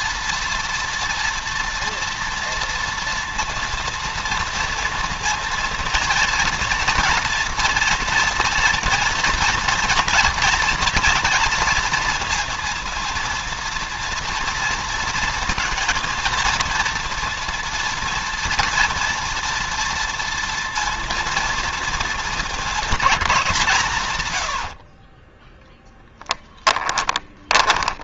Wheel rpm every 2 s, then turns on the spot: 240, 230, 230, 230, 230, 220, 230, 230, 230, 230, 230, 210, 60, 20.
24-28